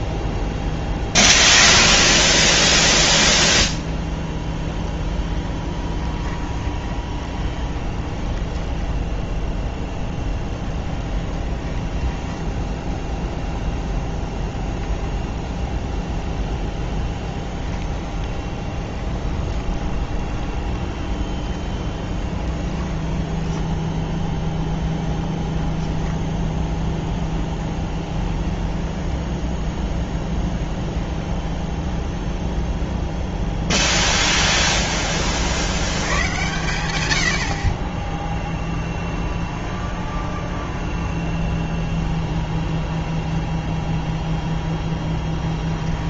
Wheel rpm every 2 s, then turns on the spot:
20, 10, 10, 20, 10, 10, 10, 0, 10, 20, 20, 20, 0, 0, 20, 0, 0, 0, 90, 0, 0, 0, 0.
4-14 18-24 28-30